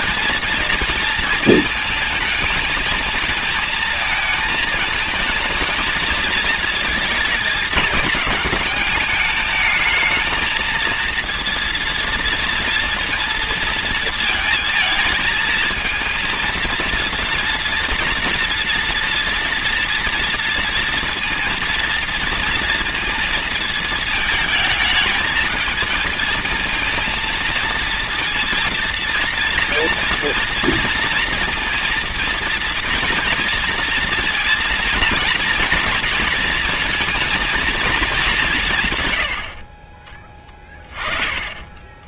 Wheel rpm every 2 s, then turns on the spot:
230, 220, 220, 220, 200, 220, 230, 230, 230, 230, 230, 230, 220, 230, 230, 230, 230, 230, 230, 150, 30.
40-42